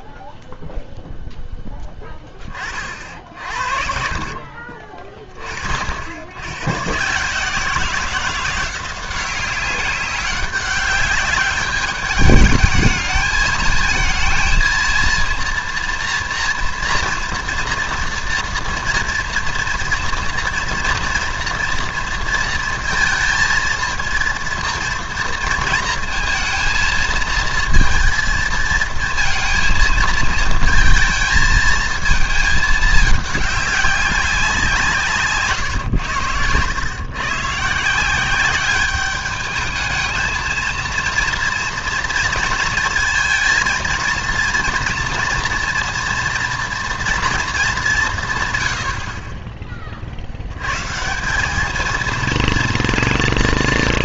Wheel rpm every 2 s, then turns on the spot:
0, 20, 40, 90, 180, 190, 210, 230, 240, 230, 230, 230, 230, 230, 220, 230, 220, 180, 100, 200, 230, 230, 230, 230, 130, 100, 230.
4-6